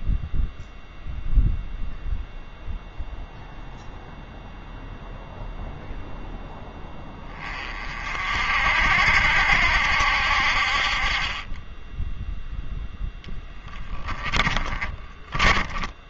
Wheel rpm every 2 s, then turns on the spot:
0, 0, 0, 10, 60, 50, 0, 20.
14-16